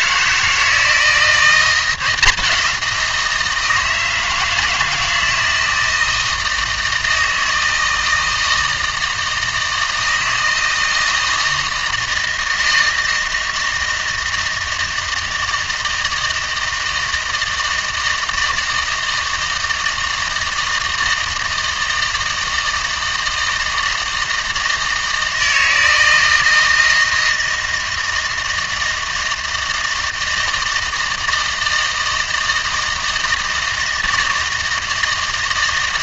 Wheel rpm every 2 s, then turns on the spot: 160, 180, 160, 160, 160, 160, 160, 160, 160, 160, 160, 160, 160, 160, 160, 160, 160, 160.
none